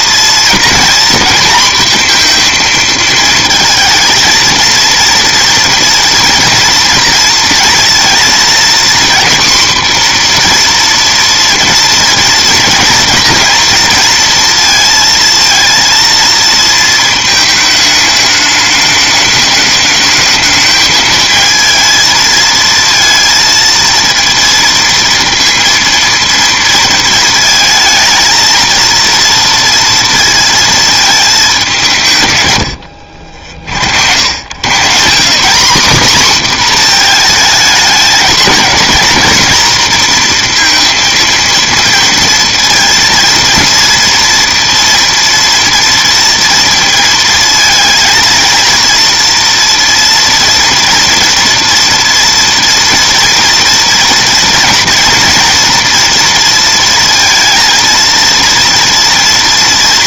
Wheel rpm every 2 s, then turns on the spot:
240, 230, 230, 230, 240, 240, 230, 230, 220, 210, 220, 220, 230, 230, 230, 230, 90, 120, 240, 220, 230, 230, 230, 230, 230, 230, 230, 230, 230, 230.
none